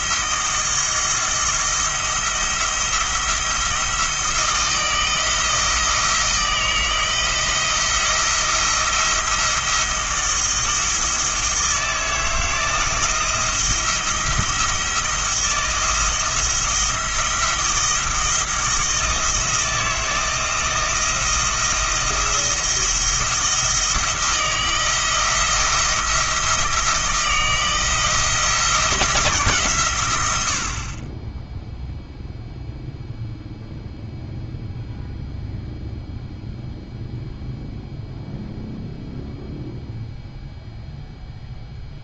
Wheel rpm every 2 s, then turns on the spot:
170, 170, 160, 160, 170, 160, 160, 170, 160, 160, 160, 170, 170, 160, 160, 50, 0, 0, 0, 0, 0.
none